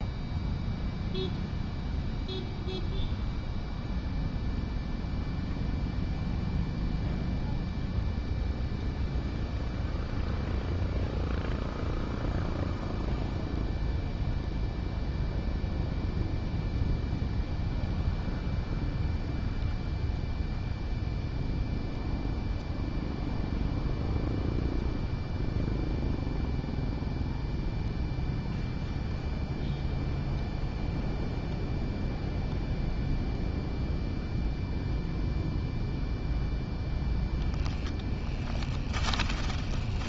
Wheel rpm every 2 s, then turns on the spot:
0, 0, 0, 0, 0, 0, 0, 0, 0, 0, 0, 0, 0, 0, 0, 0, 0, 0, 0, 20.
38-40